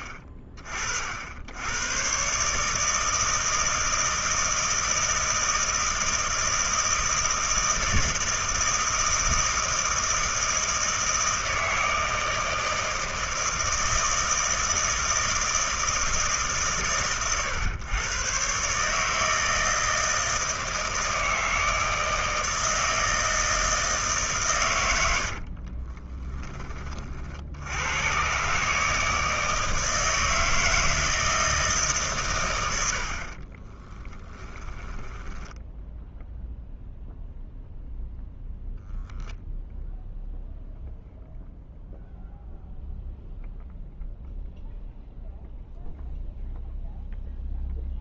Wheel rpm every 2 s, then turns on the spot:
50, 150, 160, 160, 160, 160, 160, 160, 130, 140, 160, 160, 120, 20, 150, 160, 90, 10, 0, 0, 0, 0, 0, 0.
34-36